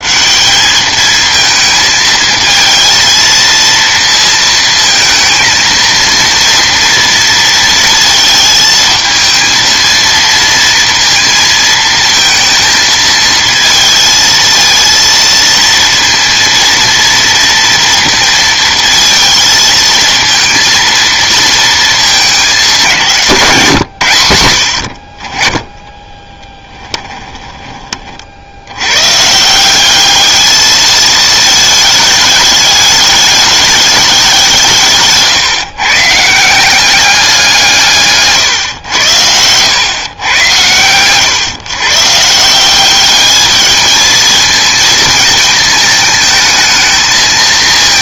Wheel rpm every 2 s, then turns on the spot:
210, 220, 230, 230, 220, 230, 230, 230, 230, 230, 230, 180, 70, 10, 90, 220, 210, 160, 180, 120, 110, 170, 220, 220.
26-28 38-40